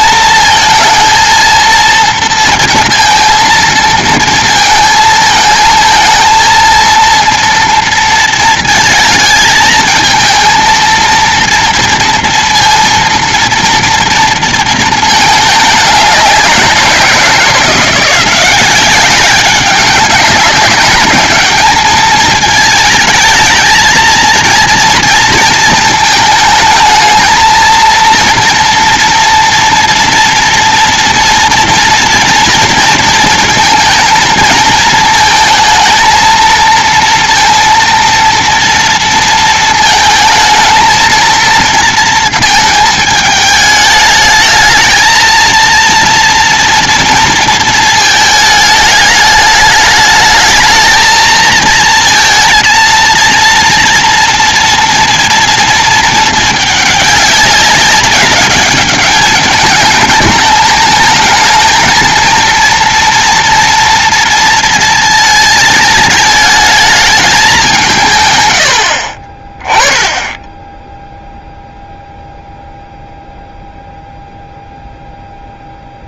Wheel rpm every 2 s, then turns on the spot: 230, 230, 230, 230, 230, 230, 230, 220, 180, 190, 200, 220, 230, 220, 230, 230, 230, 220, 230, 230, 220, 220, 220, 230, 220, 220, 230, 230, 210, 200, 210, 230, 230, 220, 80, 10, 0, 0.
none